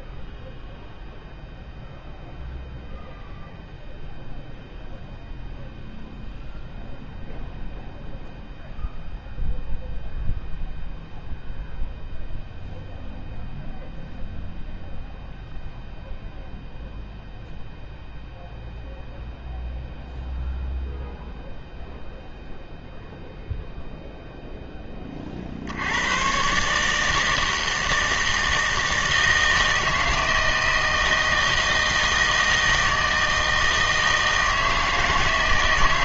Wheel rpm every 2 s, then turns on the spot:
0, 0, 0, 0, 0, 0, 0, 0, 0, 0, 0, 0, 10, 140, 160, 160, 160, 160.
none